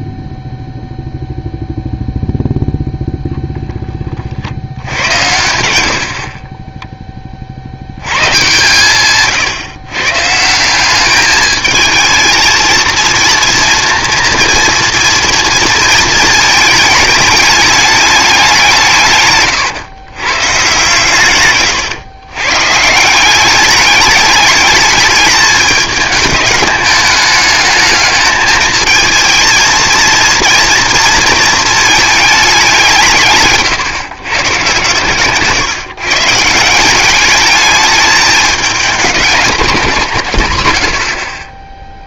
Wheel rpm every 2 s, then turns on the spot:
0, 0, 70, 20, 130, 170, 230, 240, 220, 190, 130, 130, 210, 210, 220, 230, 190, 130, 170, 220, 110.
none